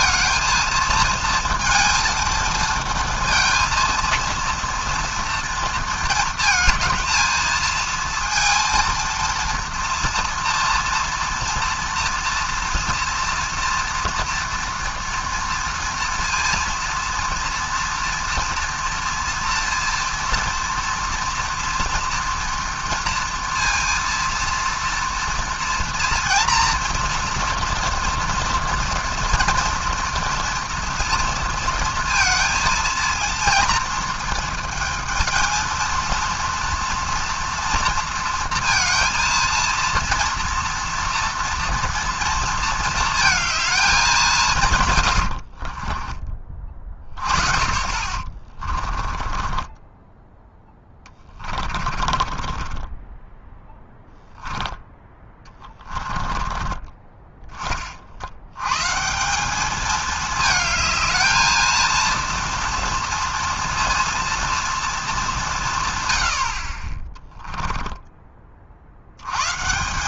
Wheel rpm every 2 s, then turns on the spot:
230, 230, 230, 230, 230, 230, 240, 230, 230, 230, 230, 230, 230, 230, 230, 230, 230, 220, 230, 230, 230, 230, 160, 30, 30, 10, 30, 10, 30, 110, 220, 230, 230, 60, 40.
48-50 52-54 56-58